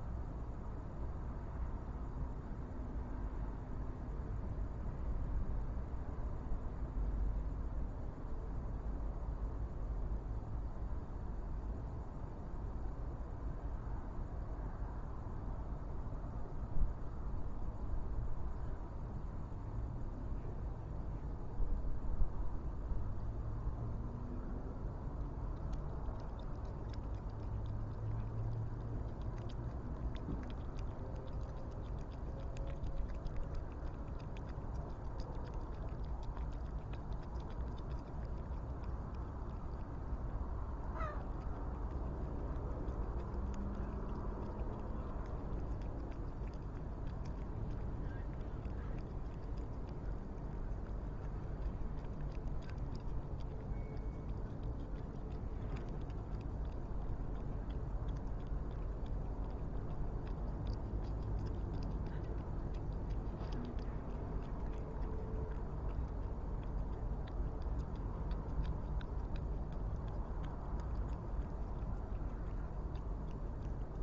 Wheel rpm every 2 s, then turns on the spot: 0, 0, 0, 0, 0, 0, 0, 0, 0, 0, 0, 0, 0, 0, 0, 0, 0, 0, 0, 0, 0, 0, 0, 0, 0, 0, 0, 0, 0, 0, 0, 0, 0, 0, 0, 0, 0.
none